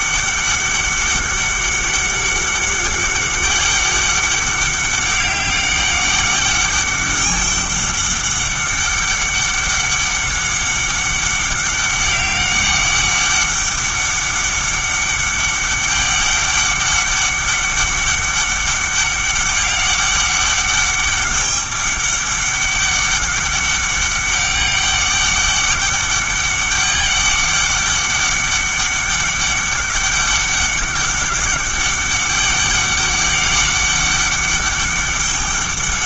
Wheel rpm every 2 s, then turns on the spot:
200, 200, 200, 200, 200, 200, 200, 200, 200, 200, 200, 200, 200, 200, 200, 200, 200, 200.
none